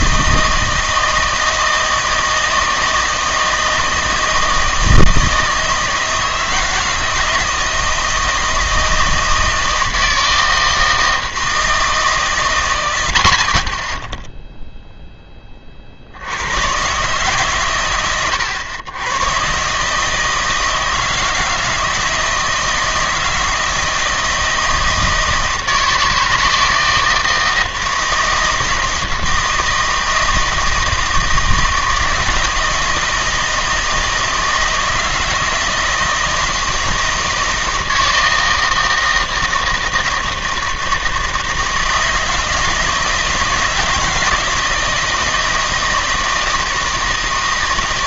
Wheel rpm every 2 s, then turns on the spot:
160, 160, 160, 160, 160, 160, 100, 0, 110, 100, 160, 160, 160, 160, 160, 160, 160, 160, 160, 160, 160, 160, 160, 160.
none